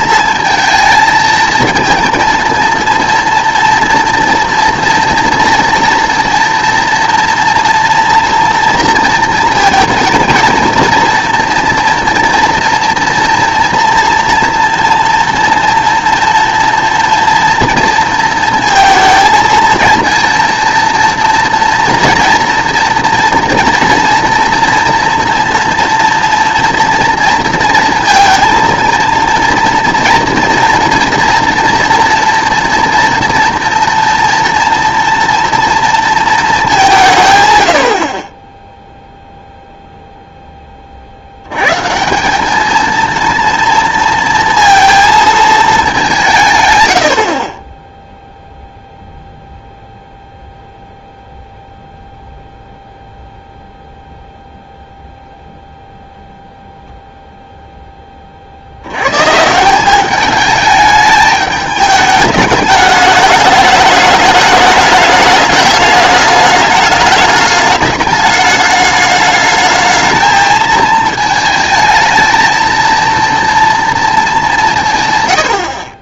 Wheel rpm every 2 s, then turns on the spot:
230, 230, 230, 230, 230, 230, 240, 230, 230, 230, 230, 230, 230, 230, 230, 240, 230, 230, 190, 0, 30, 220, 230, 130, 0, 0, 0, 0, 0, 70, 210, 210, 210, 210, 210, 230, 230, 200.
none